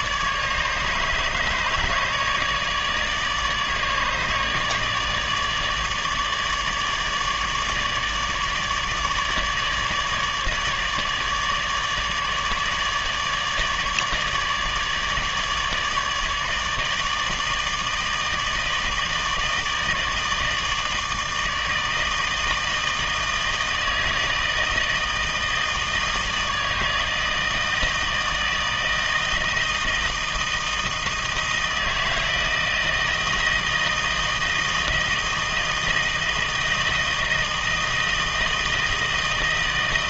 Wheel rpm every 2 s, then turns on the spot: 150, 150, 150, 150, 150, 150, 150, 150, 160, 160, 160, 160, 160, 160, 160, 160, 160, 160, 160, 160.
none